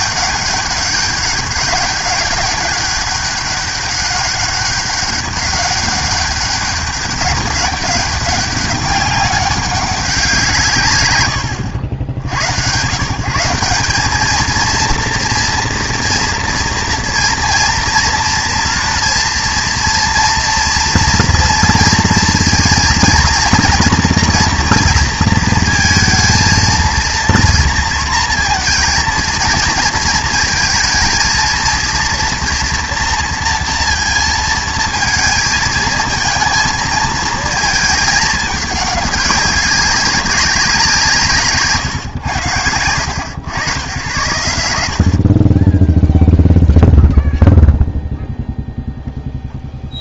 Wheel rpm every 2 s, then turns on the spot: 200, 200, 200, 200, 190, 140, 110, 220, 230, 230, 230, 230, 240, 230, 230, 230, 230, 230, 220, 210, 190, 90, 90, 0, 0.
42-44